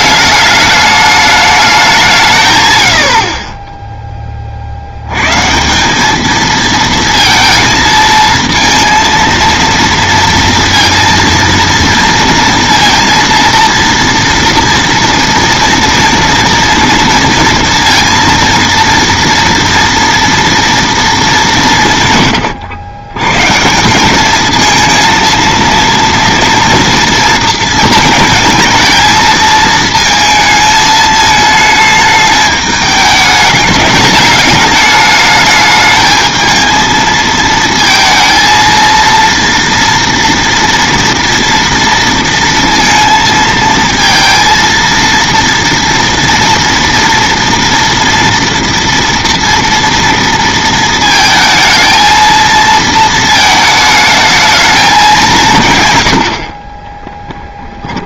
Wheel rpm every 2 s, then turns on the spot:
210, 120, 60, 230, 230, 230, 230, 230, 230, 230, 230, 100, 230, 230, 220, 220, 210, 210, 220, 230, 230, 230, 230, 230, 230, 230, 230, 220, 40.
none